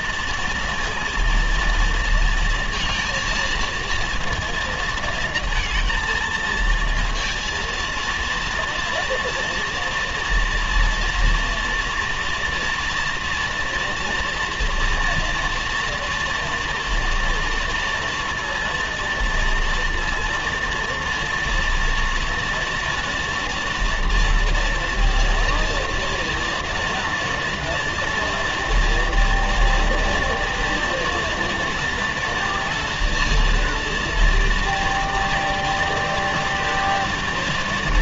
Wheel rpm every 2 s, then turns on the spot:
230, 230, 230, 220, 230, 230, 230, 230, 230, 230, 230, 230, 230, 230, 230, 230, 230, 230, 230.
none